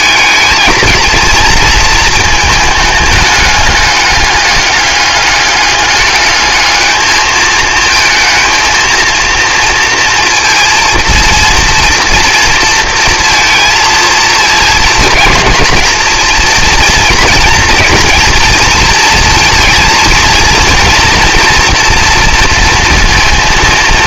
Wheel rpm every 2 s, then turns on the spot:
220, 220, 200, 210, 230, 230, 230, 230, 220, 230, 230, 230.
none